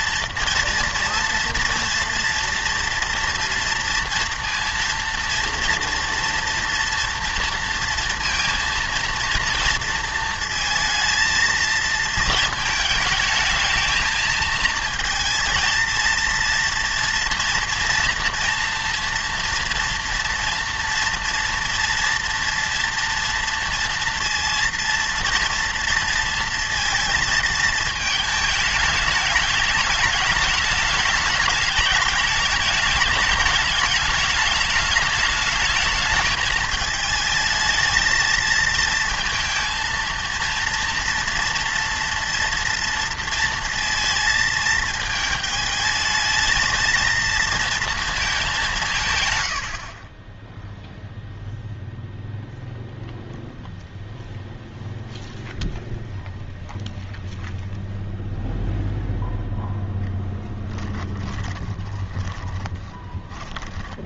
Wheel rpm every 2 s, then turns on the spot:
230, 240, 230, 230, 230, 220, 220, 230, 230, 230, 230, 230, 230, 230, 210, 210, 210, 210, 220, 220, 230, 230, 220, 220, 190, 0, 0, 0, 0, 0, 10, 20.
60-64